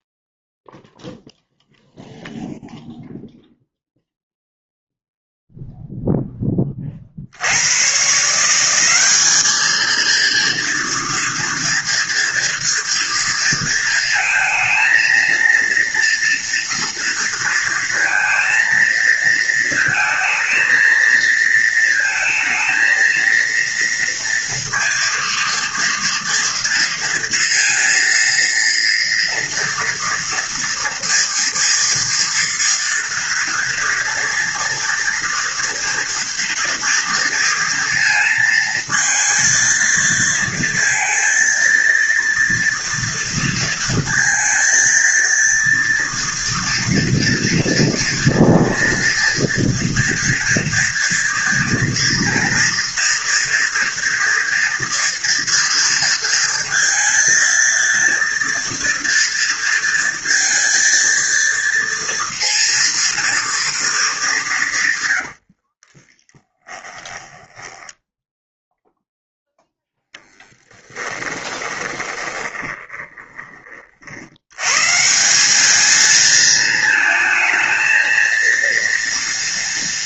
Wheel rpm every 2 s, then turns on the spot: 0, 0, 0, 30, 190, 230, 230, 230, 230, 230, 220, 230, 230, 230, 230, 230, 230, 230, 230, 230, 230, 230, 230, 240, 230, 240, 240, 230, 230, 230, 230, 230, 130, 10, 0, 10, 20, 150, 220, 230.
64-68 70-74